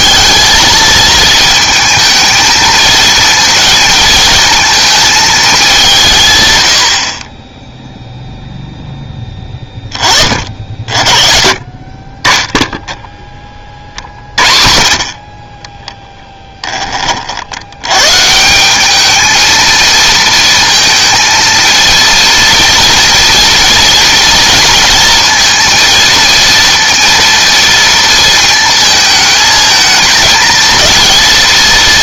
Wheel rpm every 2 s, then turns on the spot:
220, 220, 220, 90, 0, 50, 0, 50, 10, 190, 230, 230, 230, 230, 220, 230.
none